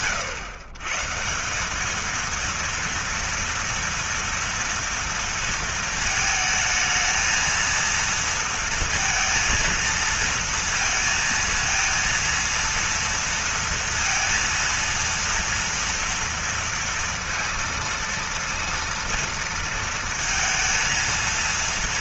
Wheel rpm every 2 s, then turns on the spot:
130, 230, 230, 220, 230, 230, 230, 230, 230, 230, 230.
none